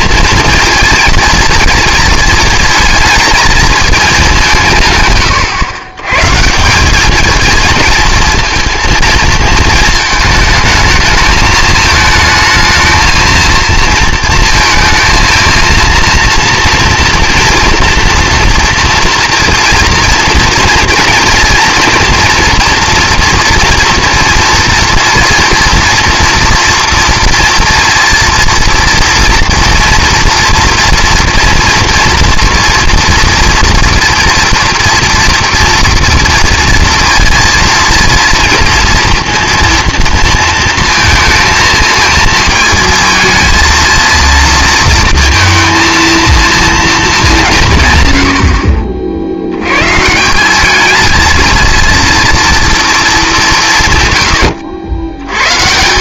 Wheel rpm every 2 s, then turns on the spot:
230, 220, 160, 170, 230, 220, 220, 230, 230, 240, 230, 230, 230, 230, 230, 230, 230, 230, 230, 230, 230, 230, 230, 230, 50, 210, 230, 90.
none